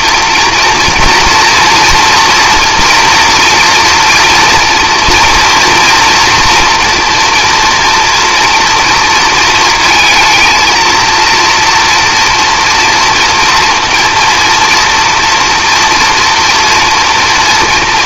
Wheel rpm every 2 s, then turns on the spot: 230, 230, 230, 240, 230, 230, 230, 230, 240.
none